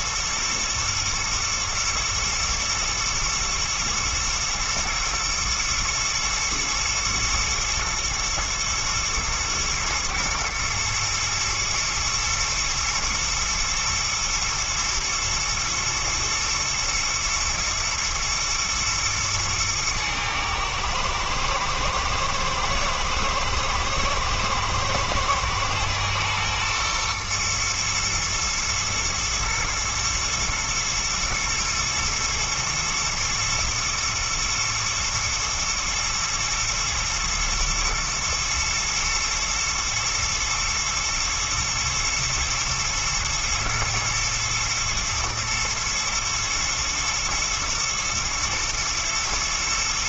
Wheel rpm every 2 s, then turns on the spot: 110, 110, 120, 110, 120, 120, 120, 120, 120, 110, 110, 110, 110, 120, 110, 120, 110, 110, 110, 110, 120, 110, 120, 120, 120.
none